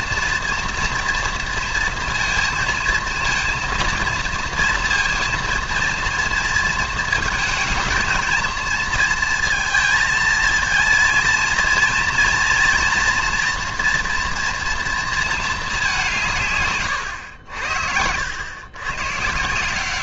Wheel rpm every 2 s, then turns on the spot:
240, 230, 230, 230, 230, 230, 230, 230, 140, 110.
none